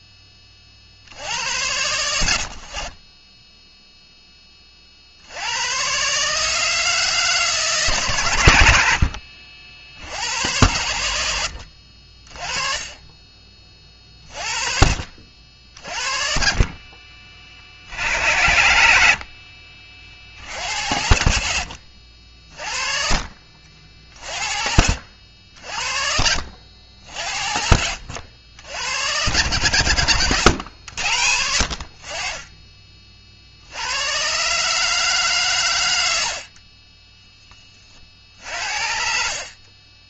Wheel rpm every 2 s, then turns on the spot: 60, 30, 50, 150, 70, 90, 20, 50, 30, 70, 80, 40, 60, 70, 100, 90, 40, 150, 20, 50.
12-14 18-20 26-28